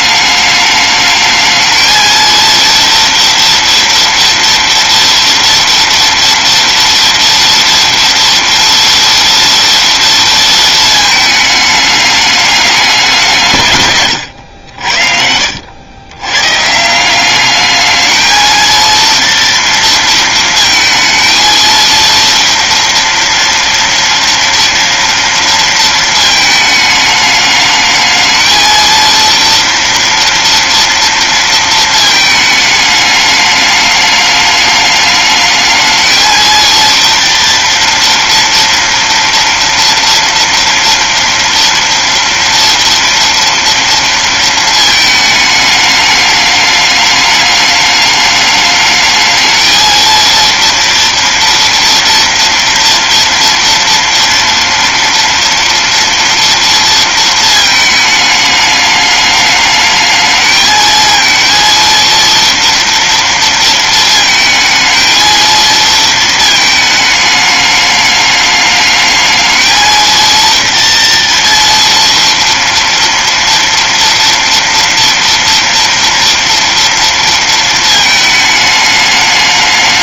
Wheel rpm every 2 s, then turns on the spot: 220, 230, 230, 230, 230, 220, 170, 70, 200, 230, 230, 240, 230, 210, 230, 230, 210, 210, 230, 230, 230, 230, 220, 210, 220, 230, 230, 230, 220, 210, 230, 230, 230, 210, 220, 230, 230, 230, 230, 210.
none